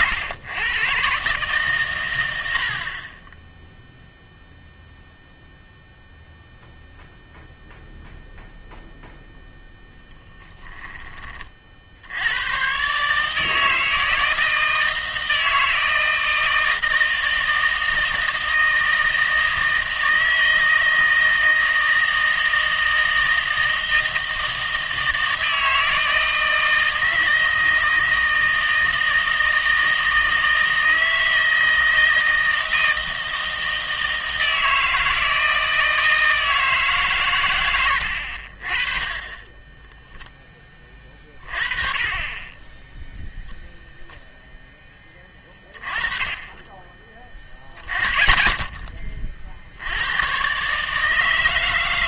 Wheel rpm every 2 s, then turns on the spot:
110, 60, 0, 0, 0, 10, 130, 160, 160, 160, 160, 160, 160, 160, 160, 160, 160, 160, 150, 40, 20, 20, 10, 20, 20, 130.
none